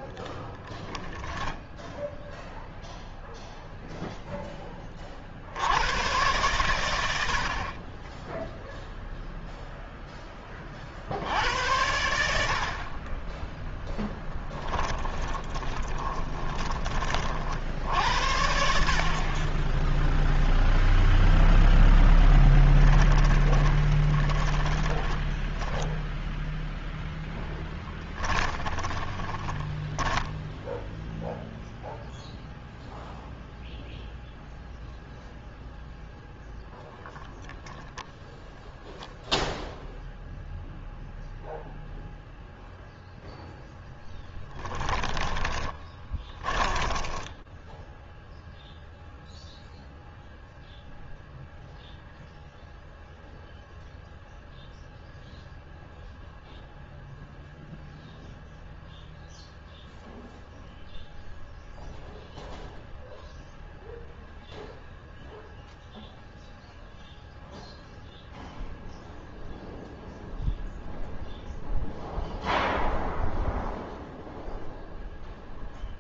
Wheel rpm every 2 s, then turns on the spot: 0, 0, 10, 110, 10, 20, 70, 10, 20, 70, 0, 10, 20, 0, 10, 0, 0, 0, 0, 0, 0, 0, 10, 20, 0, 0, 0, 0, 0, 0, 0, 0, 0, 0, 0, 0, 0, 0.
14-18 22-26 28-30 44-48